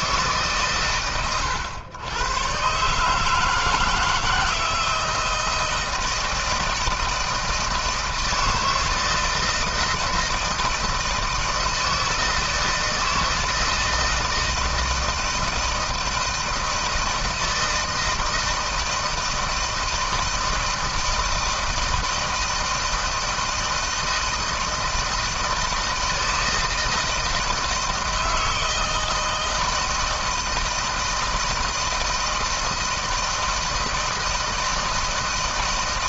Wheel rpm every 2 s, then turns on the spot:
130, 130, 160, 160, 160, 160, 160, 160, 160, 160, 160, 160, 160, 160, 160, 160, 160, 160.
none